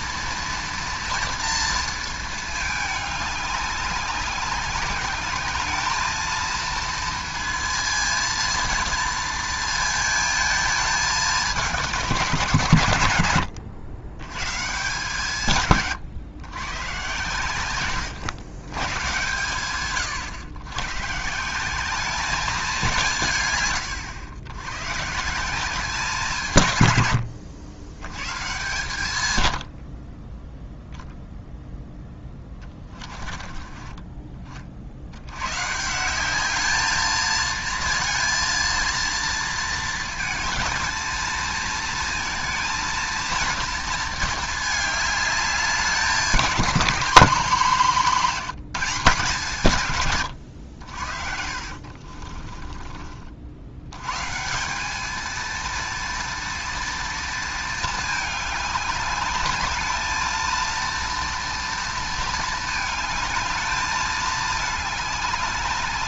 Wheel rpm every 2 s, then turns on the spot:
230, 220, 190, 230, 230, 220, 140, 140, 120, 120, 110, 200, 120, 140, 140, 0, 20, 50, 210, 230, 220, 230, 220, 200, 190, 80, 30, 180, 230, 210, 230, 220, 210.
50-54